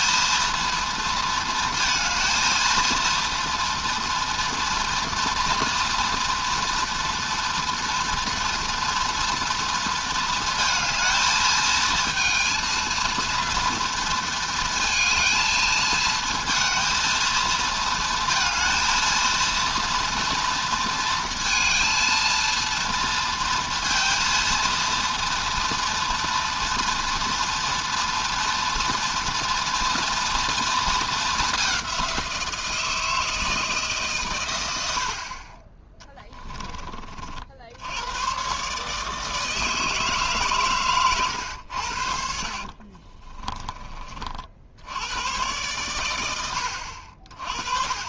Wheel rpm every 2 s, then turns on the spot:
220, 230, 230, 230, 230, 230, 230, 230, 220, 230, 230, 230, 230, 230, 240, 230, 180, 130, 10, 100, 150, 70, 50, 100.
42-44